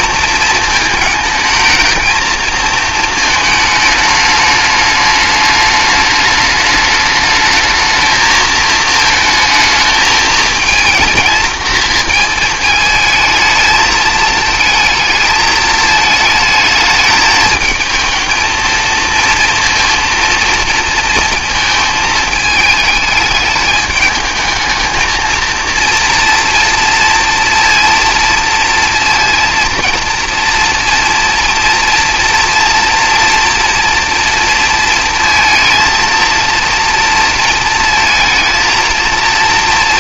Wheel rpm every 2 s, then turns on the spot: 220, 230, 210, 210, 220, 230, 220, 220, 220, 230, 230, 210, 220, 230, 230, 240, 230, 230, 230, 230.
none